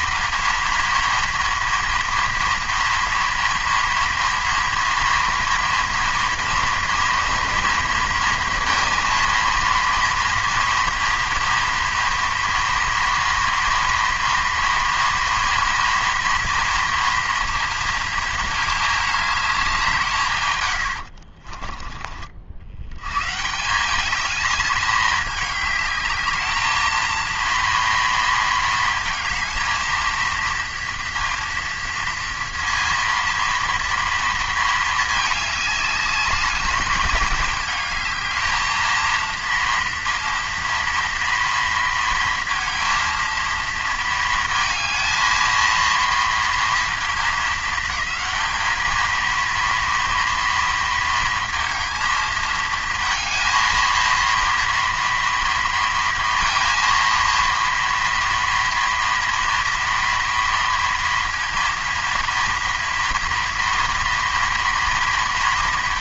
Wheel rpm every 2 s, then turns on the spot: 230, 240, 230, 230, 240, 230, 230, 230, 230, 220, 120, 70, 210, 220, 230, 230, 230, 220, 210, 220, 230, 230, 230, 230, 220, 230, 230, 230, 230, 230, 230, 230, 230.
none